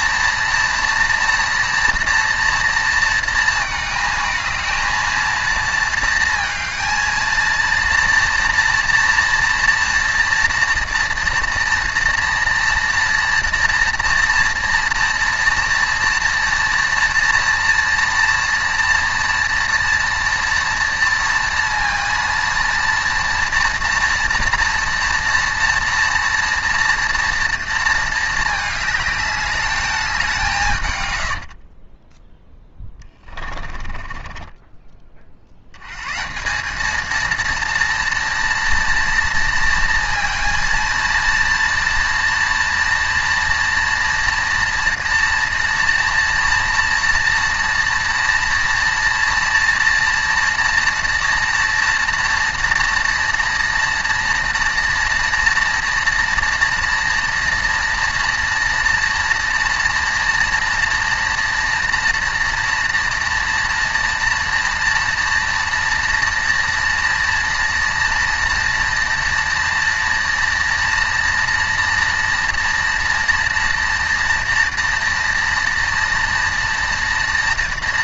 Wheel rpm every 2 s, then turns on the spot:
230, 230, 220, 230, 240, 240, 240, 230, 230, 230, 230, 230, 230, 230, 210, 140, 20, 20, 200, 230, 230, 230, 230, 230, 230, 230, 230, 230, 230, 230, 230, 230, 230, 230, 230, 230, 240, 230, 230.
32-34